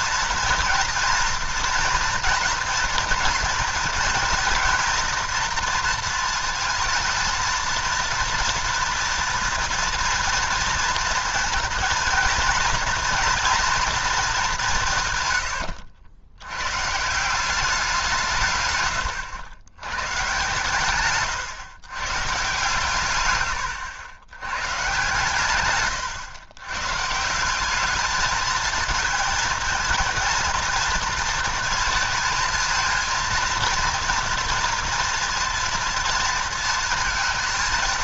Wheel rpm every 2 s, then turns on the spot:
230, 230, 240, 220, 230, 230, 230, 190, 110, 140, 130, 130, 120, 130, 220, 230, 230, 230, 220.
none